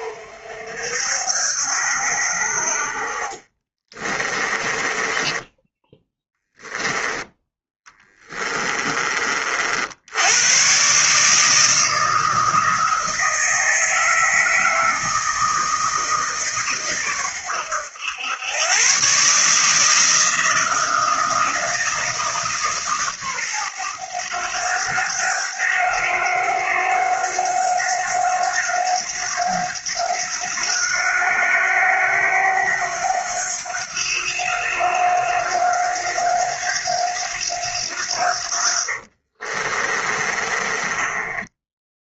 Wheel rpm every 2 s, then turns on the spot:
70, 50, 20, 10, 30, 130, 160, 160, 130, 120, 160, 140, 100, 90, 90, 90, 90, 90, 90, 50, 20.
4-6 38-42